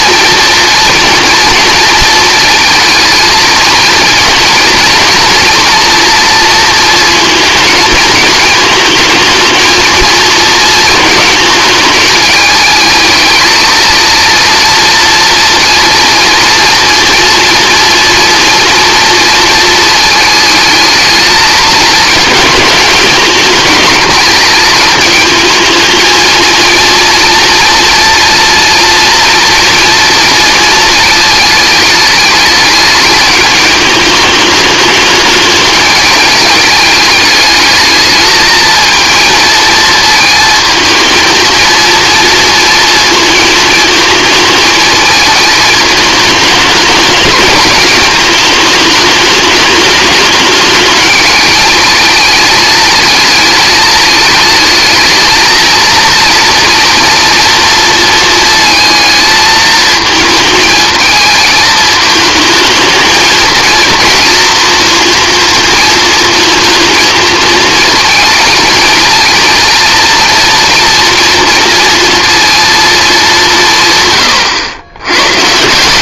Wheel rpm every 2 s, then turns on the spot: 230, 220, 230, 230, 230, 220, 230, 230, 230, 230, 220, 210, 220, 240, 240, 220, 210, 210, 220, 230, 230, 220, 220, 210, 210, 220, 220, 220, 230, 230, 220, 220, 230, 220, 230, 240, 180, 120.
none